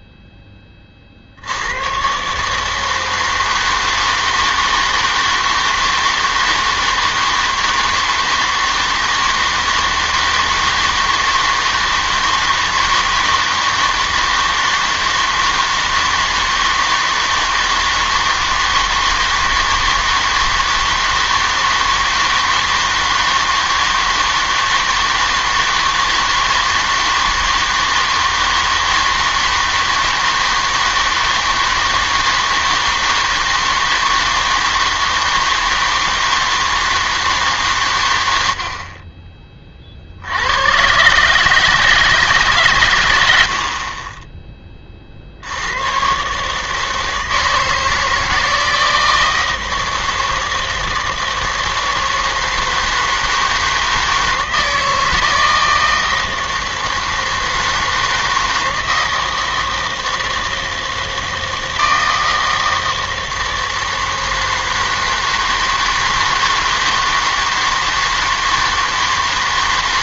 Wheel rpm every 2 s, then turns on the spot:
10, 150, 160, 160, 160, 160, 160, 160, 160, 160, 160, 160, 160, 160, 160, 160, 160, 160, 160, 70, 100, 130, 30, 150, 160, 160, 160, 160, 160, 160, 160, 160, 160, 160, 160.
none